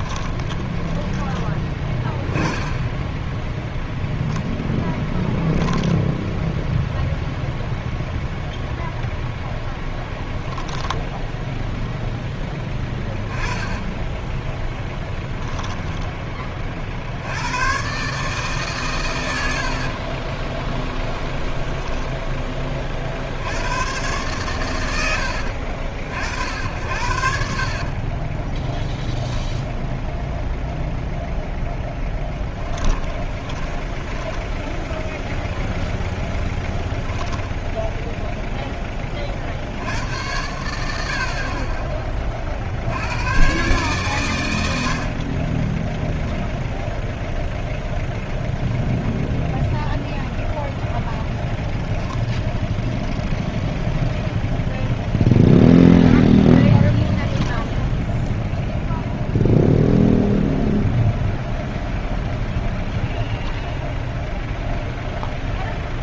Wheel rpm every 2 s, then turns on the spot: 10, 10, 10, 0, 0, 10, 10, 10, 40, 140, 10, 30, 130, 70, 0, 0, 20, 0, 10, 10, 80, 70, 70, 0, 0, 0, 0, 0, 10, 0, 0, 0, 0.
0-2 10-12 14-16 20-22 26-28 32-34 36-38 56-58